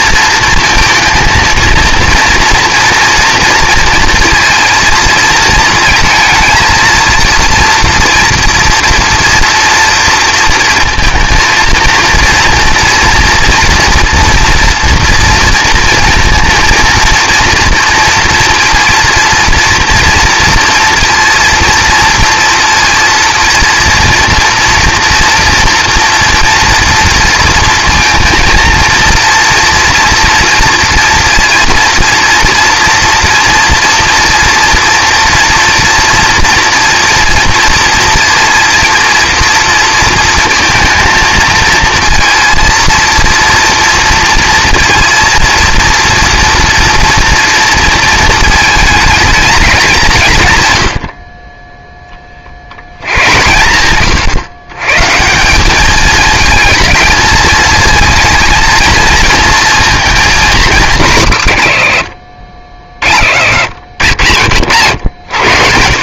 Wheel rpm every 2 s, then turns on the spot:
230, 230, 230, 230, 230, 230, 230, 230, 230, 230, 230, 230, 240, 230, 230, 230, 240, 230, 240, 230, 230, 230, 230, 230, 220, 110, 60, 130, 220, 230, 200, 40, 70.
none